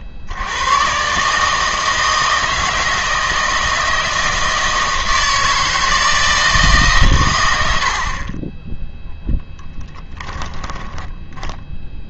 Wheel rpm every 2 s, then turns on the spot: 80, 160, 160, 160, 20, 30.
8-12